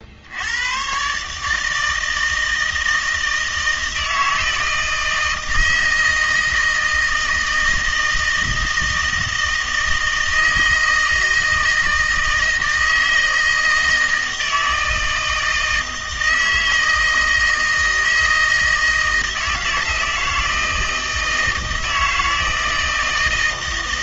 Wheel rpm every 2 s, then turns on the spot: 110, 160, 160, 160, 160, 160, 160, 160, 160, 160, 160, 160.
none